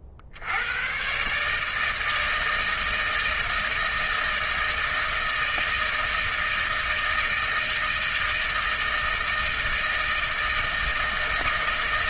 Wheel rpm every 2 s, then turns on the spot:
80, 160, 160, 160, 160, 160.
none